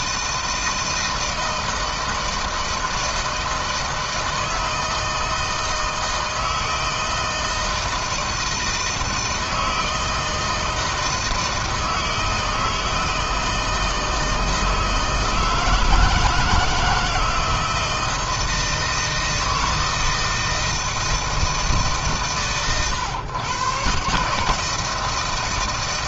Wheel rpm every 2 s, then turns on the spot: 160, 160, 160, 160, 160, 160, 160, 160, 160, 160, 160, 120, 150.
none